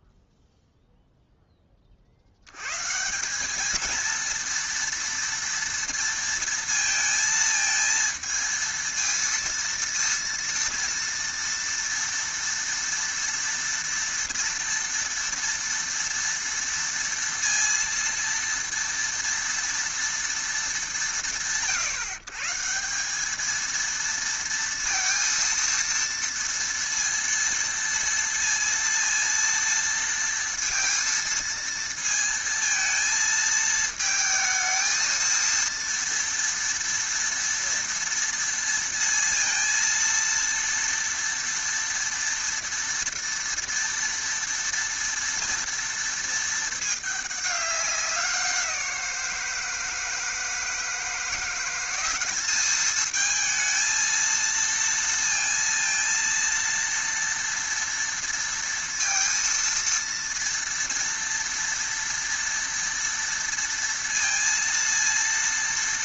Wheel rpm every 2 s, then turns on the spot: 0, 110, 230, 230, 230, 230, 230, 230, 230, 230, 170, 150, 230, 230, 230, 230, 230, 220, 230, 230, 230, 230, 230, 220, 180, 160, 210, 230, 230, 230, 230, 230, 230.
none